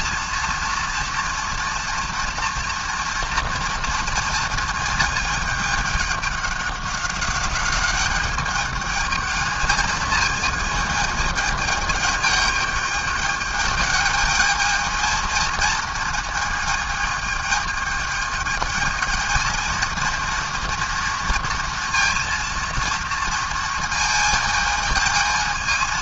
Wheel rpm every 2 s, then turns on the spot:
230, 230, 220, 200, 210, 220, 210, 220, 220, 220, 230, 230, 220.
none